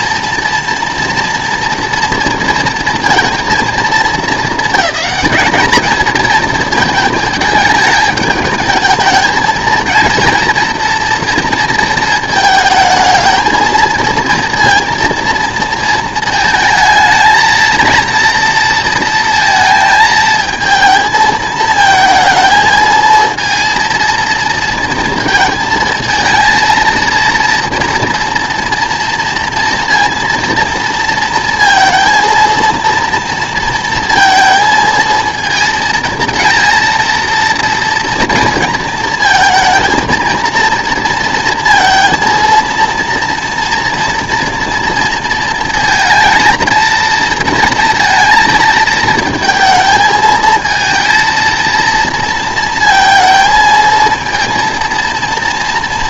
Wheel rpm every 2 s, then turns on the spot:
240, 230, 220, 220, 210, 230, 220, 230, 220, 230, 220, 230, 230, 230, 230, 230, 230, 230, 230, 230, 220, 230, 230, 230, 230, 220, 230, 230.
none